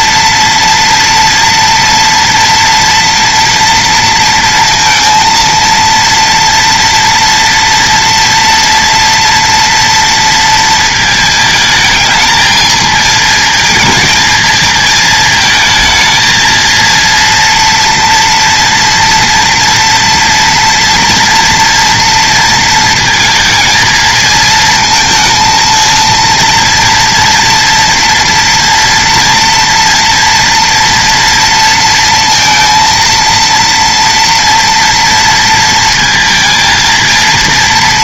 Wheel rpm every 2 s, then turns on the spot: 230, 230, 230, 230, 230, 220, 220, 220, 230, 230, 240, 230, 230, 230, 230, 230, 230, 230, 220.
none